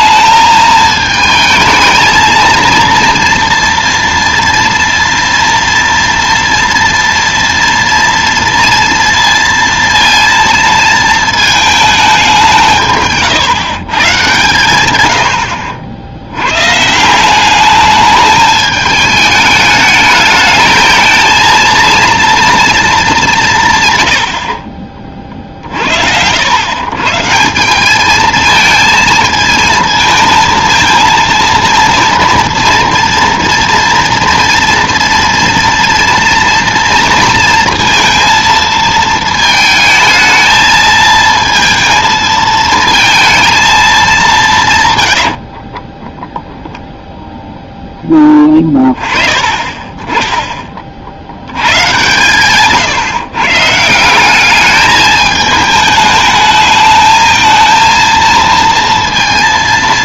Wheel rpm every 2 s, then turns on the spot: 220, 230, 230, 230, 230, 230, 160, 110, 130, 220, 220, 230, 60, 110, 220, 230, 230, 230, 230, 220, 220, 220, 150, 10, 20, 20, 140, 210, 220, 230.
none